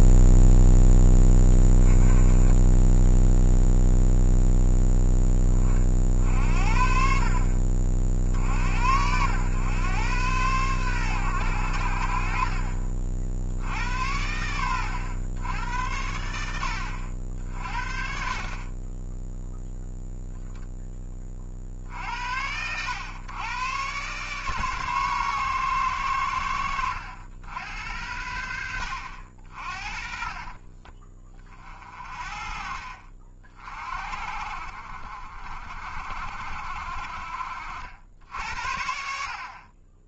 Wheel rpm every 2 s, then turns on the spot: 0, 0, 10, 50, 70, 110, 50, 100, 80, 30, 10, 90, 140, 80, 70, 30, 50, 60, 60, 70.
none